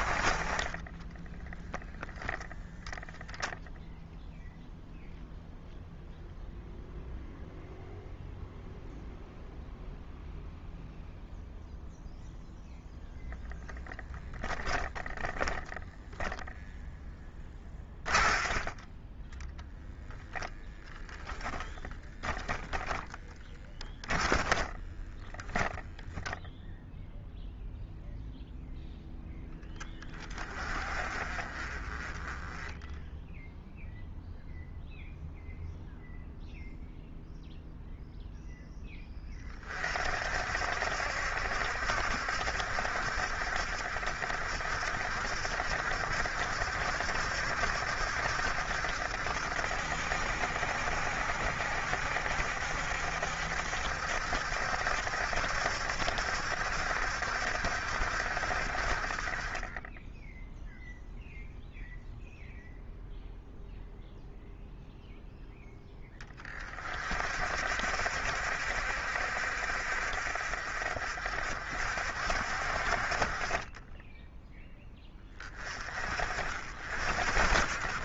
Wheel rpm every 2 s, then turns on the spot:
30, 0, 0, 0, 0, 0, 0, 10, 0, 20, 0, 10, 10, 0, 0, 40, 10, 0, 0, 10, 60, 60, 60, 70, 70, 70, 70, 70, 70, 50, 0, 0, 0, 30, 60, 50, 60, 10, 60.
0-2 22-26